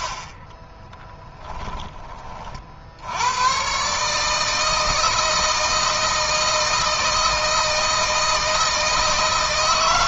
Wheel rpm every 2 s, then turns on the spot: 10, 50, 160, 160, 160.
0-2